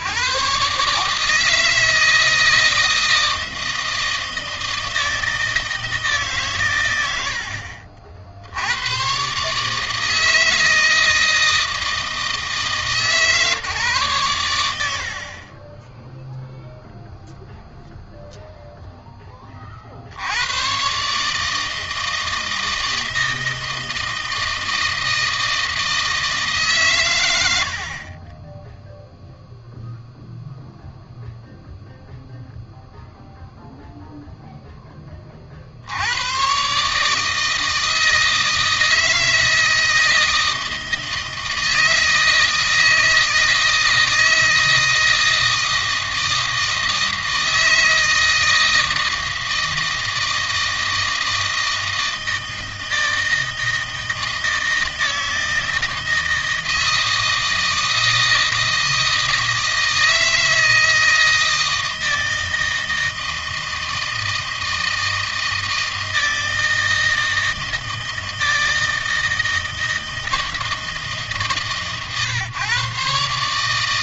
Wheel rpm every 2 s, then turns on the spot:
140, 160, 160, 120, 100, 160, 150, 80, 0, 0, 120, 160, 160, 130, 10, 0, 0, 10, 140, 160, 160, 160, 160, 160, 160, 160, 160, 160, 160, 160, 160, 160, 160, 160, 160, 160, 130.
none